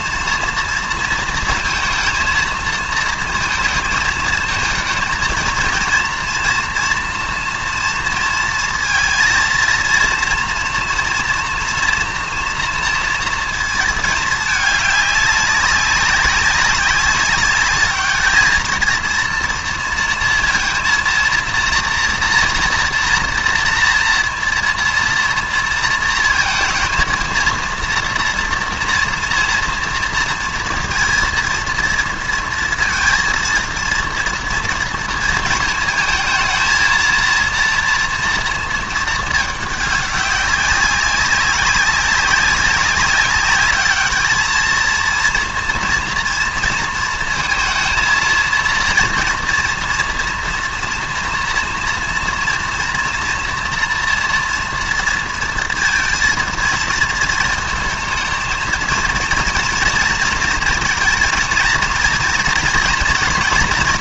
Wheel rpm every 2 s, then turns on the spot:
230, 220, 230, 230, 230, 230, 230, 210, 200, 220, 230, 230, 230, 230, 230, 230, 230, 230, 220, 220, 200, 190, 230, 230, 230, 230, 240, 230, 220, 220, 220, 230.
none